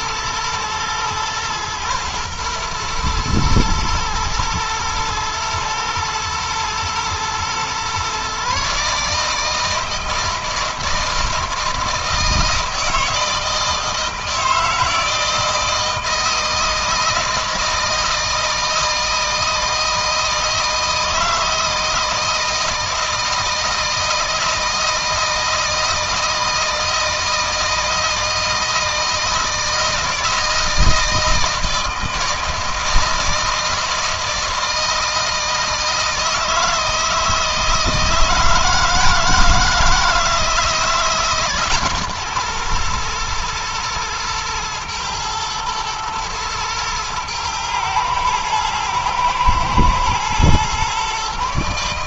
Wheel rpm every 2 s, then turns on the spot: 120, 120, 120, 120, 150, 160, 160, 160, 160, 160, 160, 160, 160, 160, 160, 160, 160, 160, 160, 160, 160, 120, 110, 110, 120, 130.
none